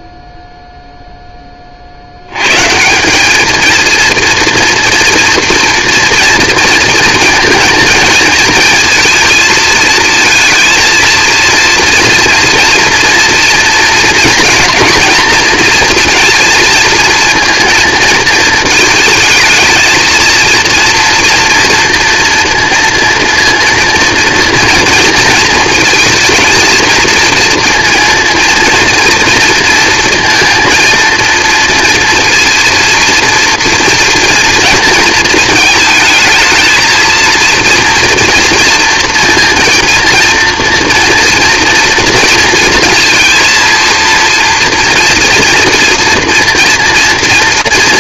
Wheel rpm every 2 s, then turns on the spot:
0, 150, 230, 230, 220, 230, 240, 220, 230, 220, 230, 230, 230, 230, 230, 230, 230, 230, 220, 230, 230, 230, 230, 230.
none